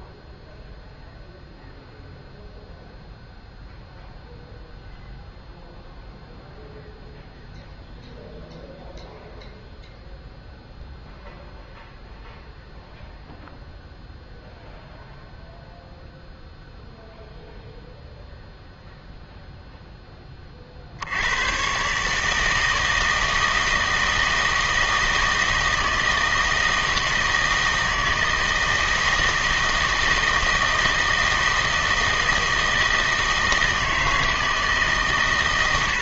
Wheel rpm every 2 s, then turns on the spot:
0, 0, 0, 0, 0, 0, 0, 0, 0, 0, 40, 160, 160, 160, 160, 160, 160, 150.
none